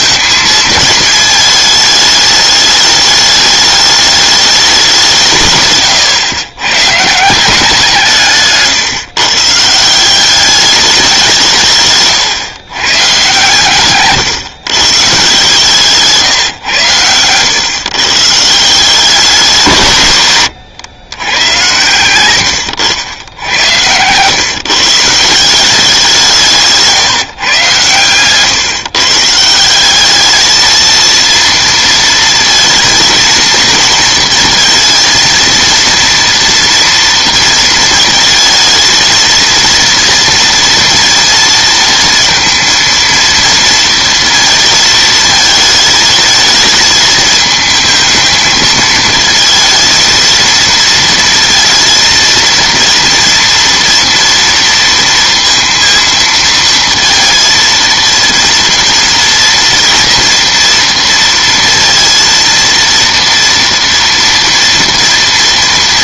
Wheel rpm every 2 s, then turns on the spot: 220, 210, 190, 130, 140, 200, 130, 140, 120, 170, 110, 90, 140, 160, 140, 220, 230, 230, 240, 220, 230, 230, 220, 220, 220, 230, 230, 230, 230, 230, 230, 230, 230.
none